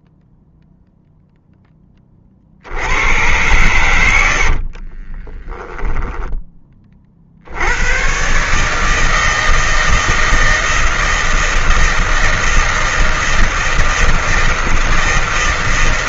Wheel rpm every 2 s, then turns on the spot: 0, 60, 70, 20, 140, 160, 160, 160.
4-6